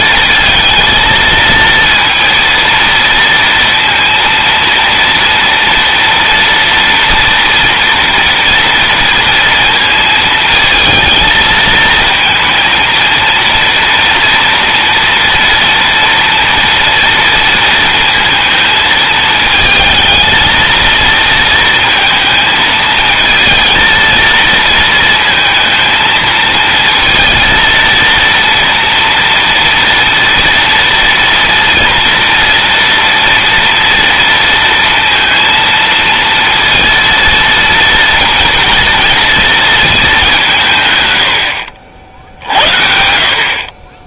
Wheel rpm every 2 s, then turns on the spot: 230, 230, 230, 230, 230, 220, 230, 230, 230, 220, 230, 220, 230, 230, 230, 230, 230, 230, 230, 230, 130, 60.
none